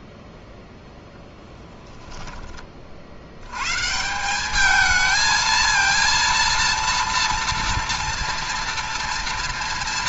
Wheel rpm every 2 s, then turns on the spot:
0, 20, 210, 230, 230.
none